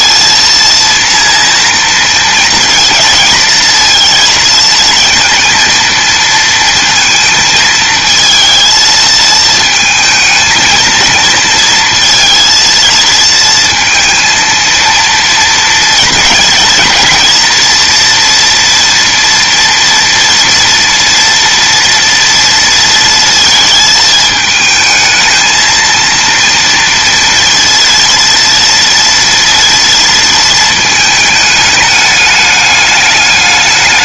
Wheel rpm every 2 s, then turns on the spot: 230, 220, 230, 220, 220, 220, 230, 230, 230, 230, 230, 230, 220, 230, 230, 220, 210.
none